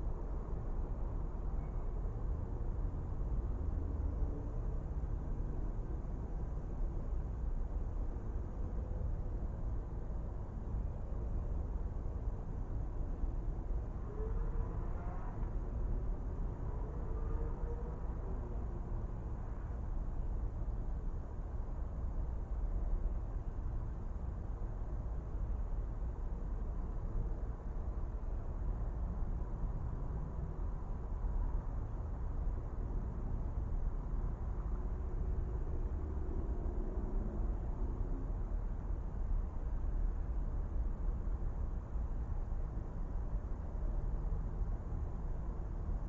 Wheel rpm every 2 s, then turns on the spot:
0, 0, 0, 0, 0, 0, 0, 0, 0, 0, 0, 0, 0, 0, 0, 0, 0, 0, 0, 0, 0, 0, 0.
none